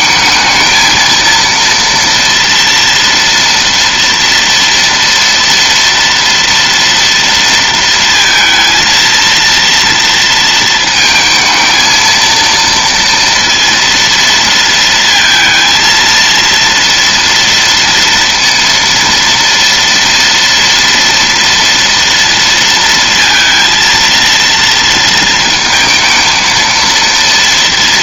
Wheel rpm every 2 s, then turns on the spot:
220, 230, 240, 230, 230, 230, 230, 230, 230, 230, 230, 230, 230, 230.
none